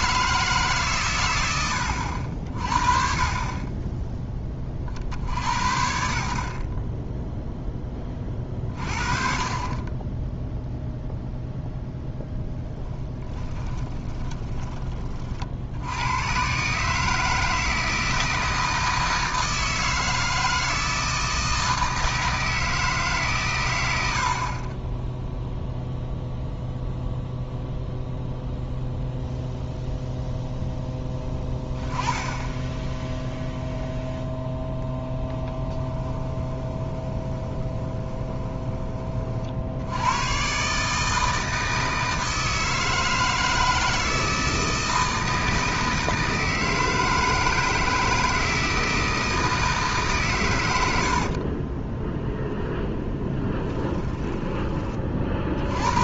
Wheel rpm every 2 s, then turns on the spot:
140, 40, 40, 30, 40, 0, 10, 20, 150, 160, 160, 150, 20, 0, 0, 0, 10, 0, 20, 20, 150, 160, 160, 160, 160, 100, 0, 30.
12-14 36-38